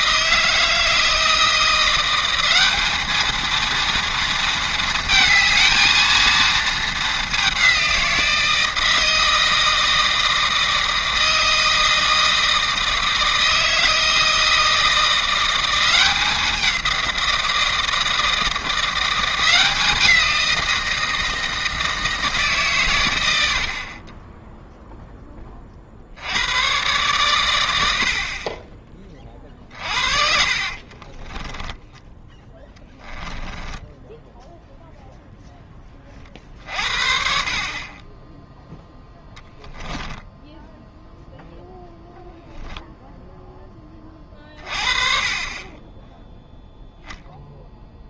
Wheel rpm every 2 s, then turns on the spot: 160, 200, 230, 220, 160, 160, 160, 160, 180, 170, 170, 130, 0, 110, 20, 50, 10, 0, 50, 0, 0, 0, 30, 0.
30-34